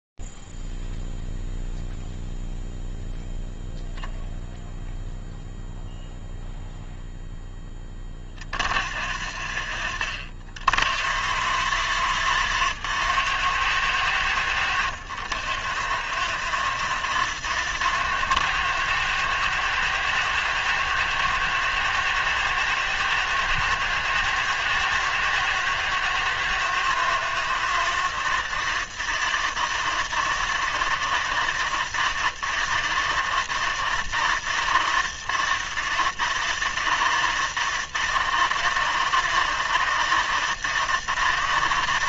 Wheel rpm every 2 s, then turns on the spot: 0, 0, 0, 0, 20, 130, 140, 160, 170, 170, 170, 170, 150, 160, 180, 180, 160, 160, 170, 170, 160.
none